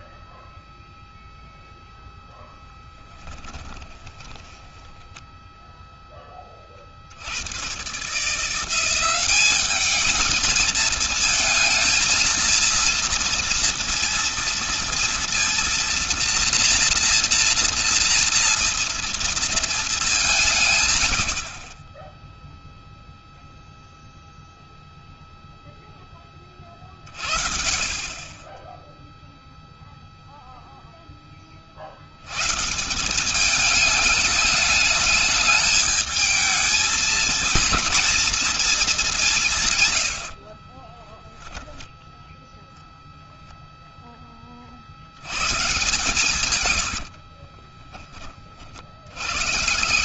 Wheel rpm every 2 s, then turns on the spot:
0, 10, 10, 60, 190, 220, 230, 230, 240, 230, 80, 0, 0, 50, 0, 10, 190, 210, 230, 200, 10, 0, 80, 50, 100.
2-6 46-48